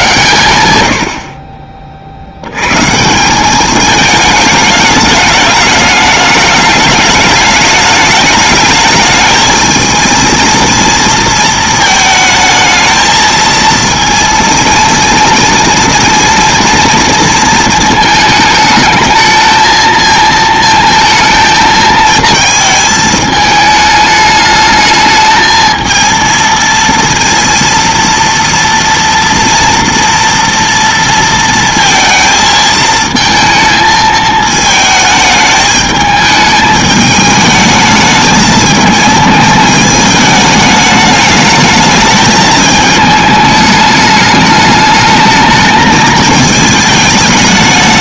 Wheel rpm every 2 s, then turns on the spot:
90, 120, 210, 210, 210, 230, 220, 230, 240, 220, 220, 220, 210, 230, 230, 230, 220, 220, 210, 210, 210, 210, 210, 220.
none